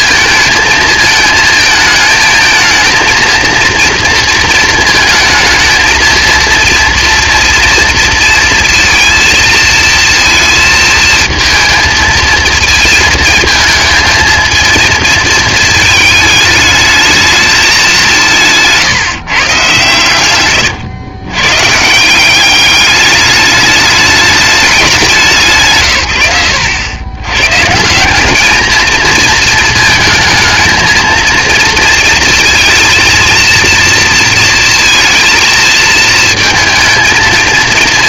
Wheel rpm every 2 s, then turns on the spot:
220, 230, 220, 230, 230, 220, 220, 220, 220, 150, 110, 210, 190, 110, 220, 230, 230, 220, 230.
none